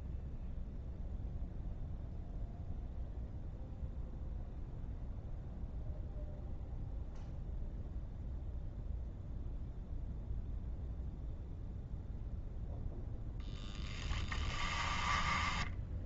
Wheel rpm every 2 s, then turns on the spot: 0, 0, 0, 0, 0, 0, 0, 10.
14-16